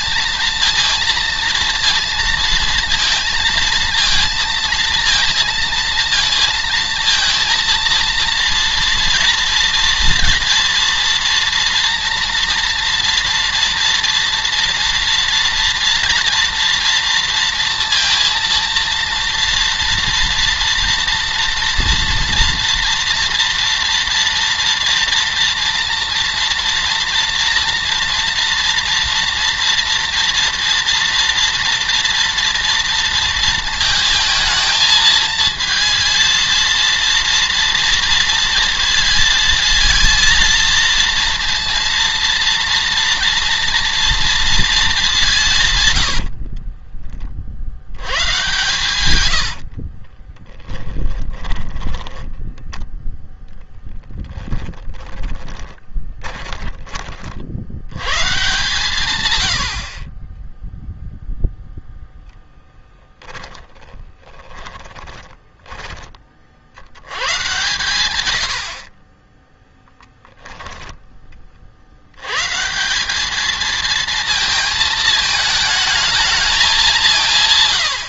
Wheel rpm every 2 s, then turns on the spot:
230, 230, 230, 230, 230, 230, 230, 230, 230, 230, 230, 230, 230, 230, 230, 230, 230, 230, 230, 230, 230, 230, 220, 40, 110, 20, 10, 20, 30, 140, 0, 10, 20, 70, 70, 10, 150, 220, 190.
46-52 54-58 64-66 68-70